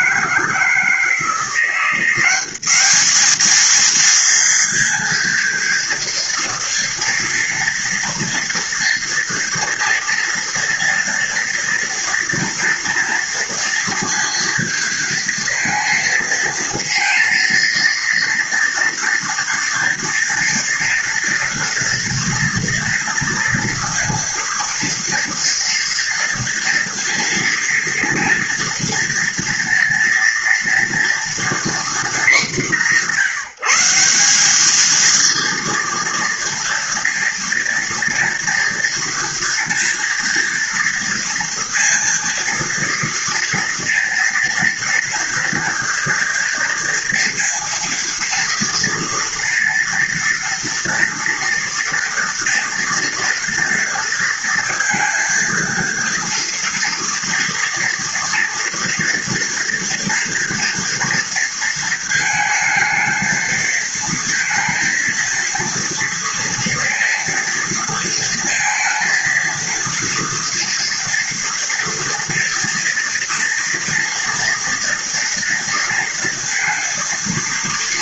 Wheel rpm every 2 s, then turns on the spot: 170, 220, 240, 230, 230, 230, 230, 230, 230, 240, 230, 230, 230, 230, 230, 230, 170, 230, 230, 230, 230, 230, 230, 230, 230, 240, 240, 230, 230, 240, 230, 220, 230, 230, 230, 230, 240, 230, 230.
none